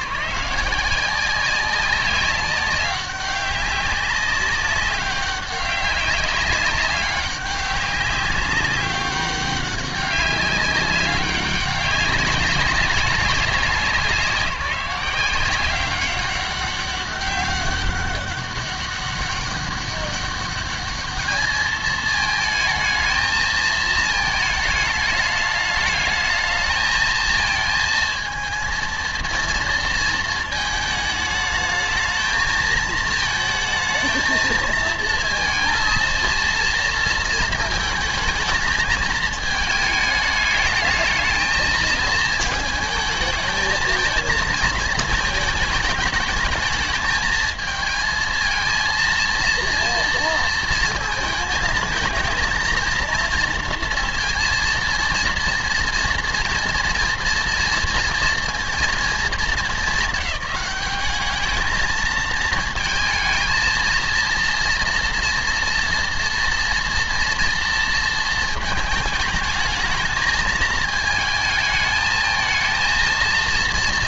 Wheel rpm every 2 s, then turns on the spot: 150, 200, 200, 200, 200, 200, 190, 180, 190, 190, 200, 220, 220, 220, 230, 220, 220, 220, 230, 220, 210, 230, 230, 220, 230, 230, 220, 230, 240, 230, 210, 220, 230, 230, 220, 220, 220.
none